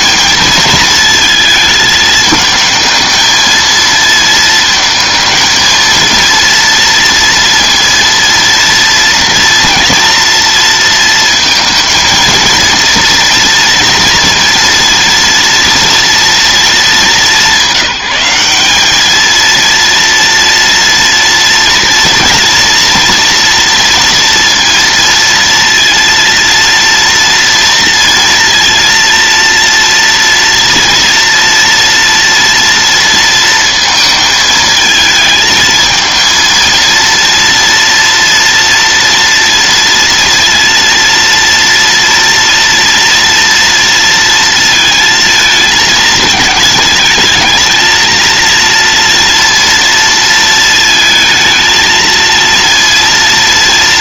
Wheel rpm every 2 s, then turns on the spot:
220, 220, 220, 230, 240, 230, 230, 230, 210, 210, 240, 240, 230, 230, 230, 230, 230, 220, 230, 230, 230, 230, 230, 220, 230, 220, 230.
none